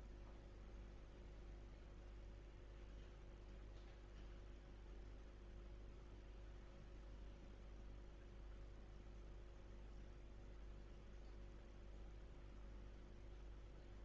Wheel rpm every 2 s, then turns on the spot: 0, 0, 0, 0, 0, 0, 0.
none